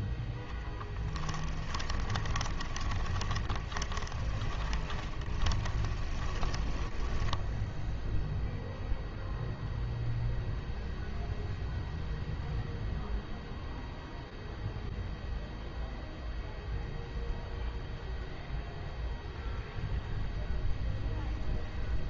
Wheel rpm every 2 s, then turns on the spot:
10, 20, 20, 10, 0, 0, 0, 0, 0, 0, 0.
2-8